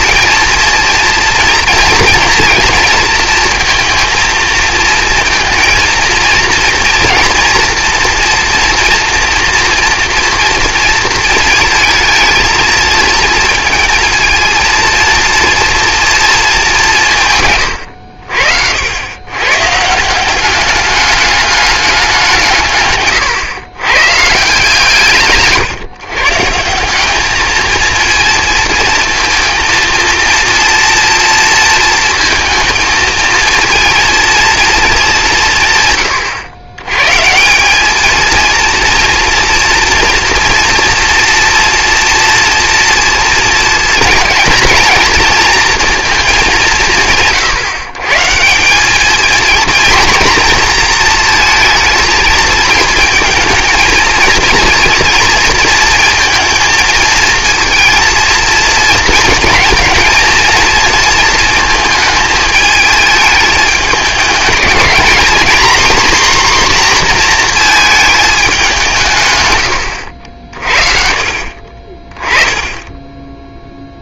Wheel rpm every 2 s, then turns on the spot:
230, 230, 230, 230, 230, 230, 230, 230, 200, 80, 200, 160, 150, 180, 230, 230, 230, 220, 120, 230, 230, 230, 230, 180, 200, 230, 220, 230, 230, 230, 230, 210, 220, 250, 180, 50, 20.
none